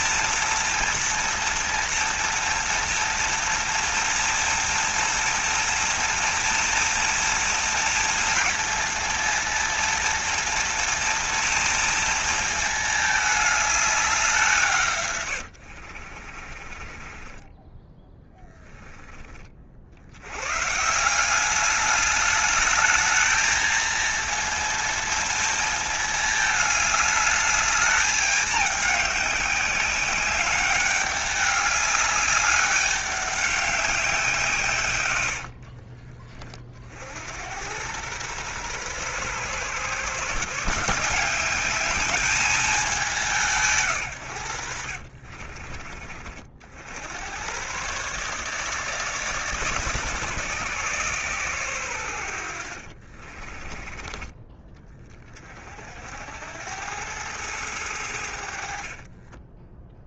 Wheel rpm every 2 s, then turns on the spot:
230, 230, 230, 230, 230, 230, 220, 140, 30, 10, 150, 210, 230, 210, 200, 200, 200, 120, 50, 120, 170, 200, 70, 70, 150, 130, 50, 30, 100, 40.
16-18 44-46 52-54 58-60